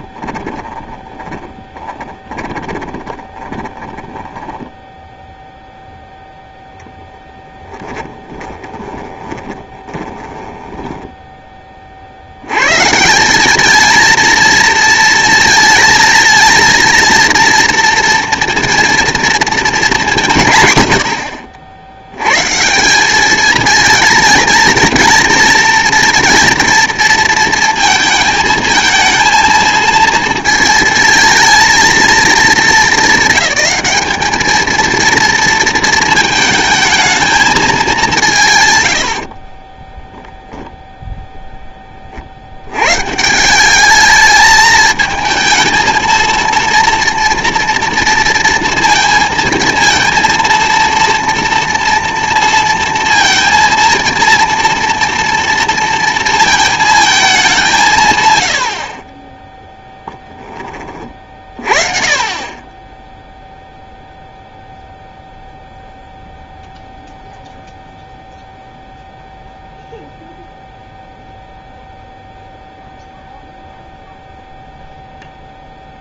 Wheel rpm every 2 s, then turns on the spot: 20, 20, 10, 0, 20, 10, 120, 220, 230, 230, 110, 160, 230, 230, 220, 230, 220, 220, 220, 130, 0, 110, 220, 230, 230, 230, 230, 230, 230, 60, 20, 20, 0, 0, 0, 0, 0, 0.
0-6 8-12